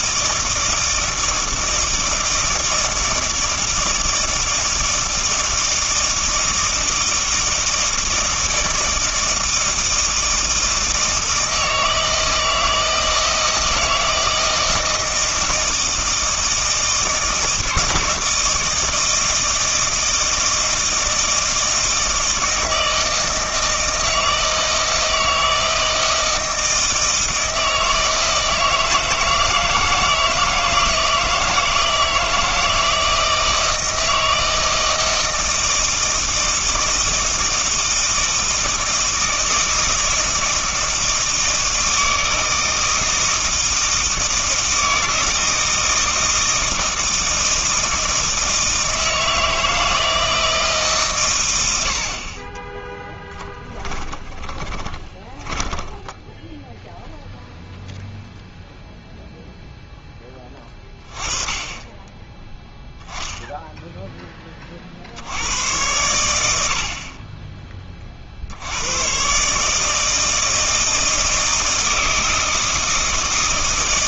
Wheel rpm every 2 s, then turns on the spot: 160, 160, 160, 160, 160, 160, 160, 160, 160, 160, 160, 160, 160, 160, 160, 160, 160, 160, 160, 160, 160, 160, 160, 160, 160, 150, 20, 20, 0, 0, 20, 10, 20, 80, 80, 160, 160.
52-56